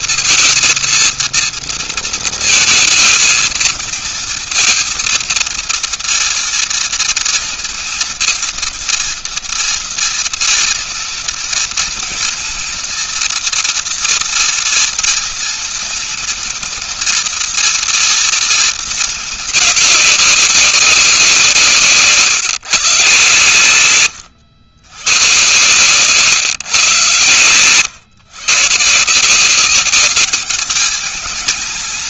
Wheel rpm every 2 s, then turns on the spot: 230, 220, 230, 230, 230, 230, 230, 230, 230, 230, 190, 140, 110, 130, 150, 210.
none